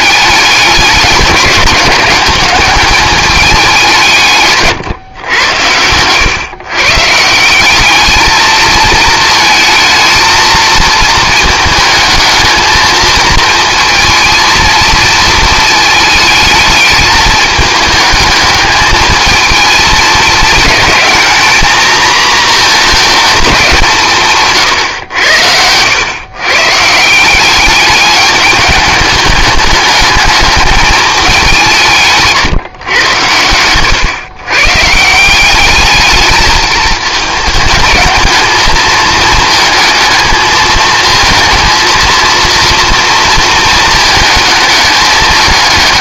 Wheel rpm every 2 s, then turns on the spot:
200, 200, 140, 130, 220, 220, 220, 230, 210, 220, 220, 220, 120, 150, 210, 210, 130, 140, 220, 220, 230, 240, 220.
none